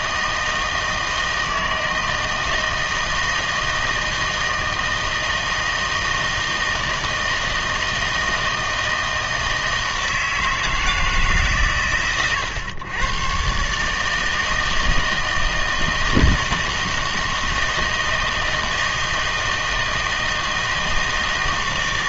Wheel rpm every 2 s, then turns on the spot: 160, 160, 160, 160, 160, 160, 110, 160, 160, 160, 160.
none